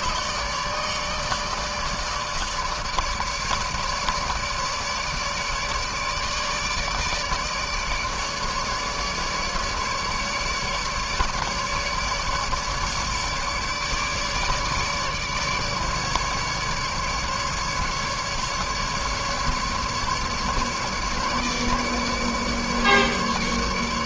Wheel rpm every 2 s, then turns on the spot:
150, 150, 150, 150, 150, 150, 150, 150, 150, 150, 150, 150.
none